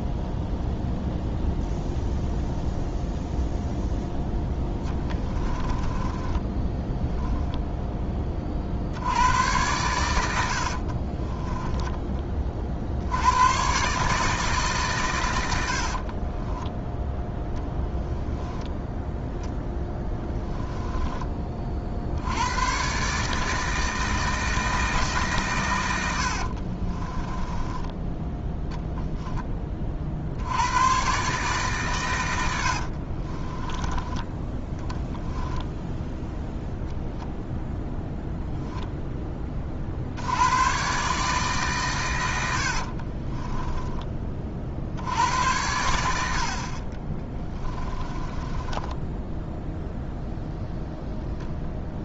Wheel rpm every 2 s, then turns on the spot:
0, 0, 10, 10, 60, 50, 60, 140, 10, 0, 10, 130, 160, 40, 0, 120, 60, 10, 0, 0, 130, 50, 70, 40, 10, 0.
4-8 10-12 20-22 26-28 32-34 42-44 46-50